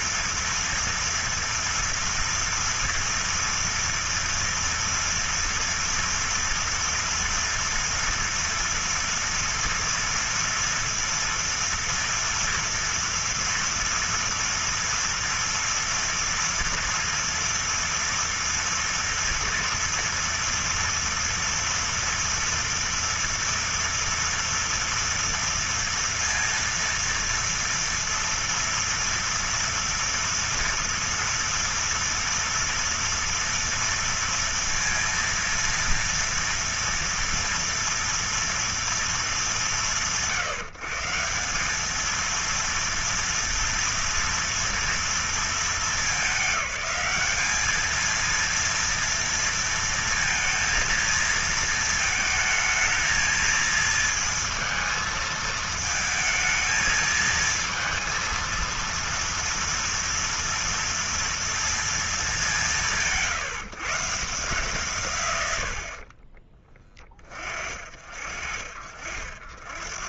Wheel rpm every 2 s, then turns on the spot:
230, 230, 230, 230, 230, 230, 230, 240, 230, 230, 230, 230, 230, 230, 230, 230, 230, 230, 230, 230, 150, 230, 240, 210, 230, 230, 220, 230, 220, 230, 230, 180, 140, 20, 50.
none